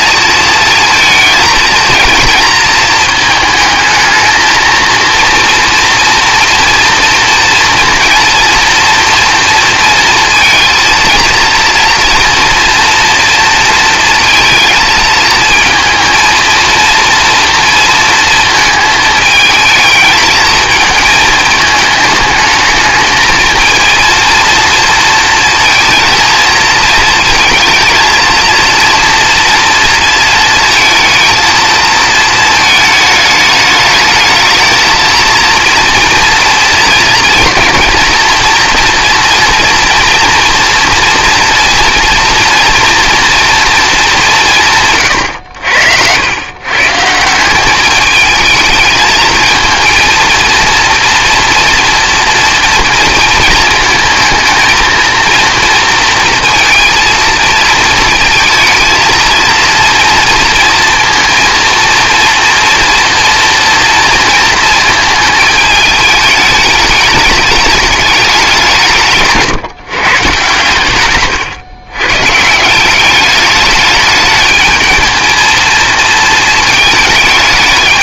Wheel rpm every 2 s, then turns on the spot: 230, 220, 230, 230, 240, 230, 230, 220, 230, 220, 220, 220, 230, 220, 230, 230, 220, 220, 240, 230, 230, 240, 160, 130, 220, 230, 230, 220, 230, 230, 230, 240, 220, 210, 180, 130, 160, 220, 220.
none